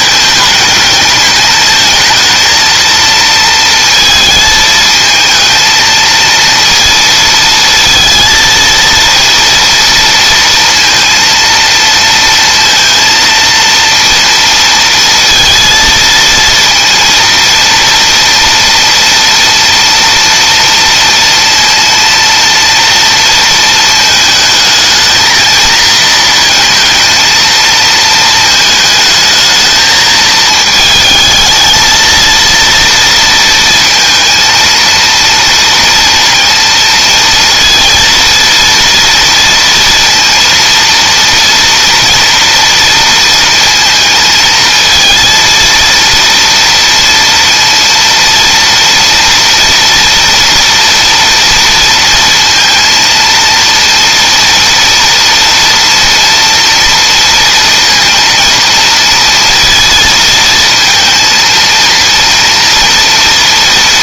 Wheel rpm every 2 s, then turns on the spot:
210, 230, 220, 230, 230, 230, 230, 230, 230, 230, 230, 230, 220, 230, 220, 220, 230, 230, 230, 230, 230, 230, 230, 230, 230, 230, 230, 230, 230, 230, 230, 240.
none